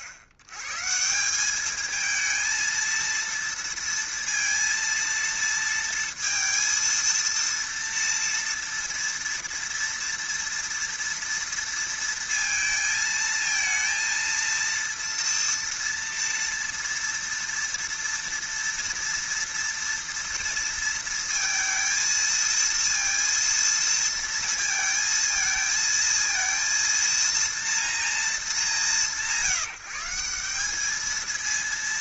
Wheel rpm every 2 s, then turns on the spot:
100, 230, 230, 230, 230, 240, 230, 230, 230, 230, 230, 230, 230, 230, 190, 200.
none